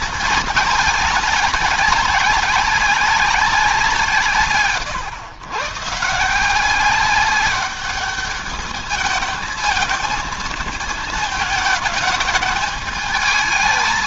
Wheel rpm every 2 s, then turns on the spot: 210, 200, 120, 190, 210, 220, 210.
none